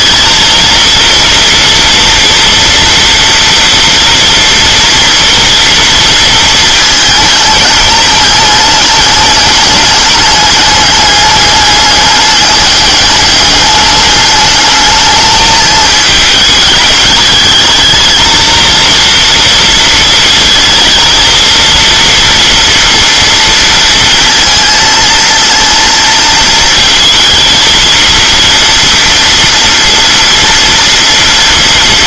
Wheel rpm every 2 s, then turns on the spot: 230, 230, 230, 220, 220, 210, 200, 210, 210, 230, 220, 230, 230, 230, 230, 230.
none